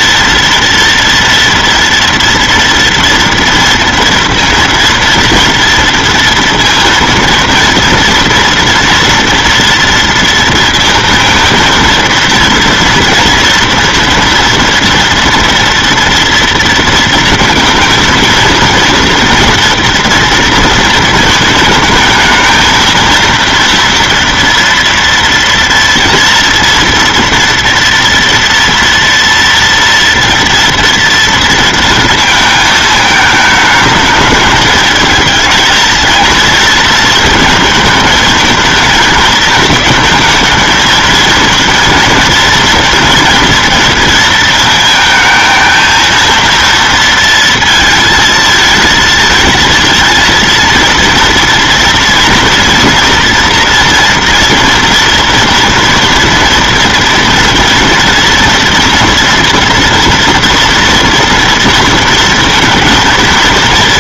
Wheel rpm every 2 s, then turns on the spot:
230, 230, 230, 230, 230, 230, 230, 230, 230, 230, 230, 230, 230, 230, 230, 230, 220, 220, 230, 220, 230, 230, 230, 230, 230, 230, 230, 240, 230, 230, 230, 230.
none